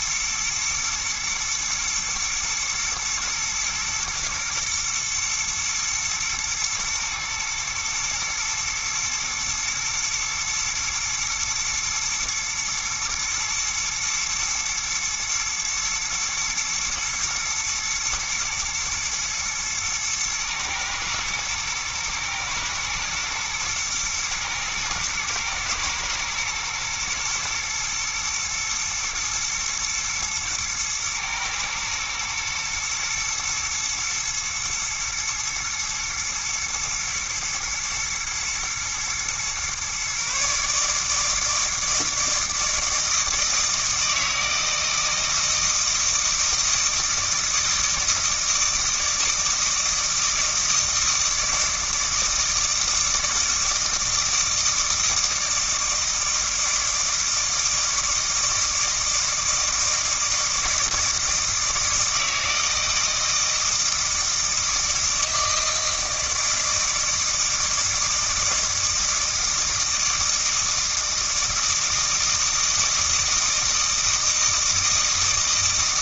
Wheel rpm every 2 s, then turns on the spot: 120, 110, 120, 110, 120, 110, 120, 120, 120, 120, 110, 110, 110, 120, 110, 110, 120, 120, 110, 120, 150, 160, 160, 160, 160, 160, 160, 160, 160, 160, 160, 160, 160, 160, 160, 160, 160, 160.
none